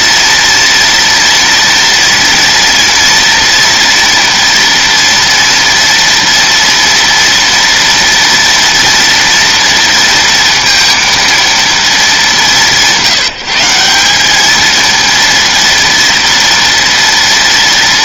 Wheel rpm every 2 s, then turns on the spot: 230, 240, 230, 230, 230, 230, 180, 220, 240.
none